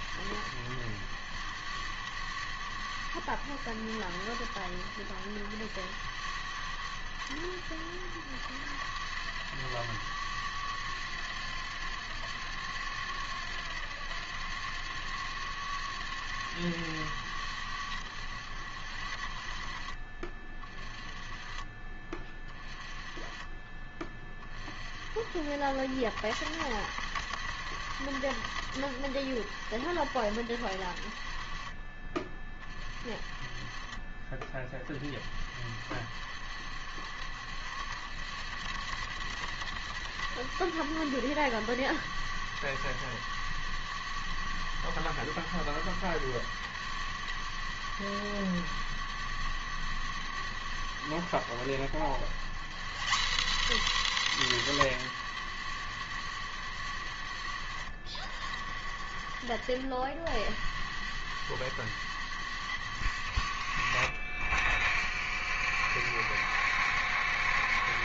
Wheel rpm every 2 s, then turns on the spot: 90, 90, 80, 90, 90, 90, 90, 90, 90, 70, 30, 30, 50, 80, 70, 60, 40, 30, 70, 80, 100, 100, 100, 100, 100, 90, 160, 130, 90, 70, 90, 90, 60, 70.
none